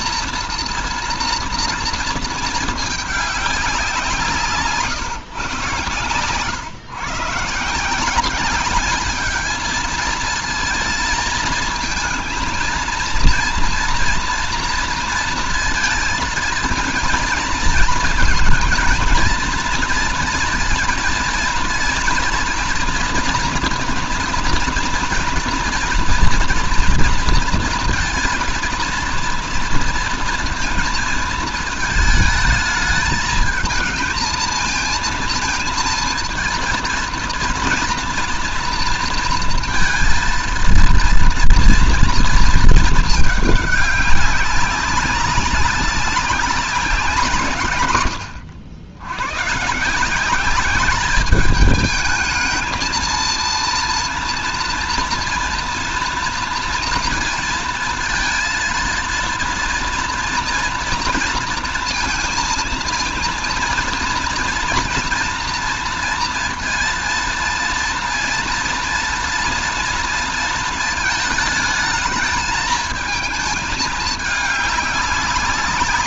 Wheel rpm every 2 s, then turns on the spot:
230, 220, 150, 120, 200, 220, 230, 230, 230, 230, 230, 230, 230, 230, 230, 230, 220, 220, 230, 230, 230, 230, 190, 190, 80, 200, 220, 230, 230, 230, 230, 230, 240, 230, 230, 230, 220, 210.
none